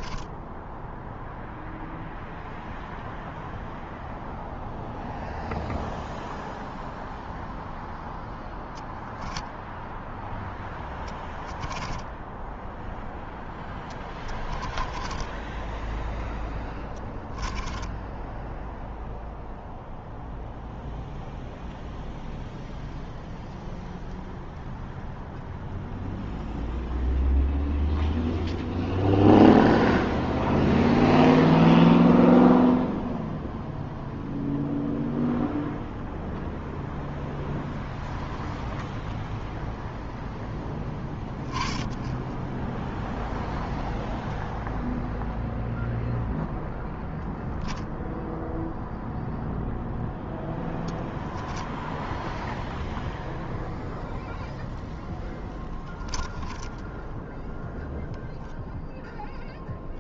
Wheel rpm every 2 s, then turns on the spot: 0, 0, 0, 0, 0, 10, 10, 10, 10, 0, 0, 0, 0, 0, 0, 0, 0, 0, 0, 0, 10, 0, 0, 0, 0, 10, 0, 10, 0, 0.
10-12 14-18 50-52 54-56